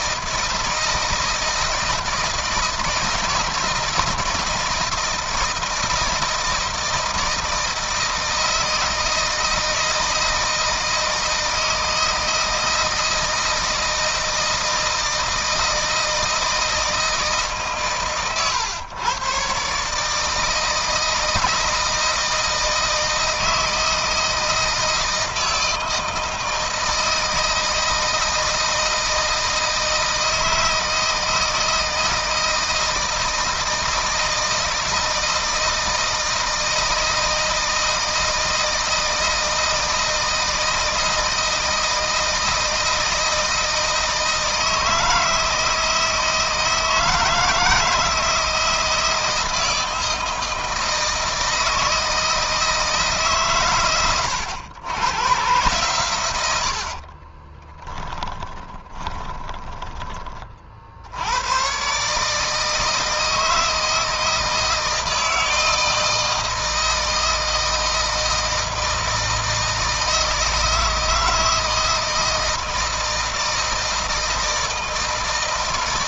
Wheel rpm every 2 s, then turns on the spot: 160, 160, 160, 160, 160, 160, 160, 160, 160, 120, 160, 160, 160, 160, 160, 160, 160, 160, 160, 160, 160, 160, 160, 160, 160, 160, 160, 90, 80, 20, 40, 150, 160, 160, 160, 160, 160, 160.
56-60